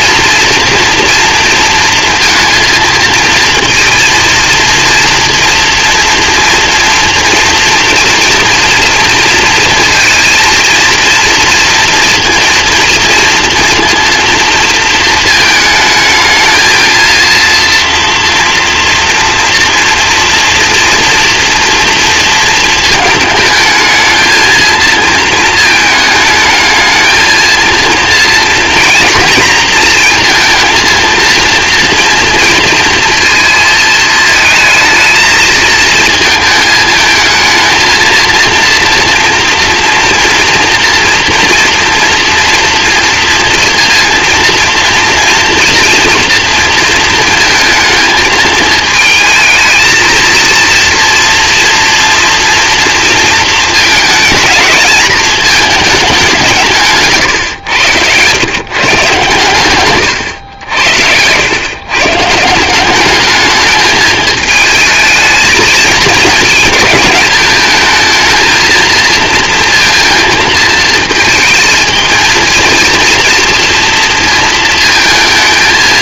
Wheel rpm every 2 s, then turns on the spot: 230, 230, 230, 230, 230, 230, 230, 230, 220, 230, 230, 230, 220, 220, 230, 230, 230, 220, 220, 240, 230, 240, 230, 230, 220, 230, 230, 230, 170, 130, 80, 170, 220, 210, 230, 220, 230, 230.
none